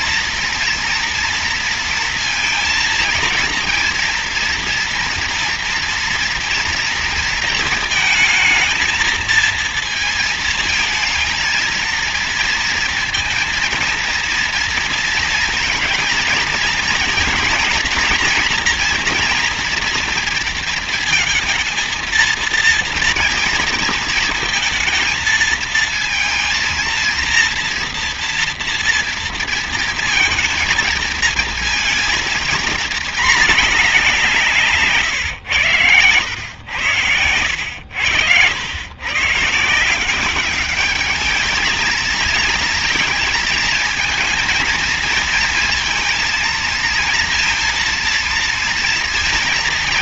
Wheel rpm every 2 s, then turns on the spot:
230, 230, 230, 230, 230, 220, 230, 230, 220, 230, 230, 230, 220, 230, 230, 220, 230, 140, 110, 120, 210, 230, 220, 230, 230.
none